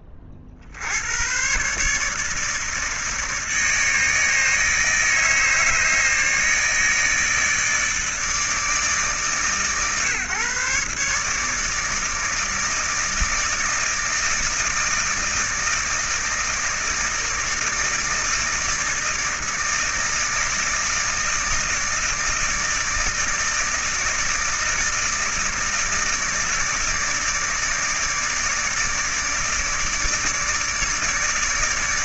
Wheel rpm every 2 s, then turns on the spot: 70, 150, 160, 150, 150, 140, 160, 160, 160, 160, 160, 160, 160, 150, 150, 150.
none